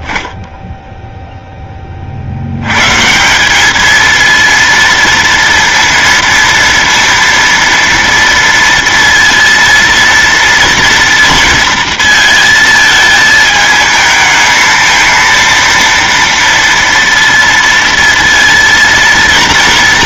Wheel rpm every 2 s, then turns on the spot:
0, 70, 230, 230, 230, 230, 230, 220, 230, 230.
none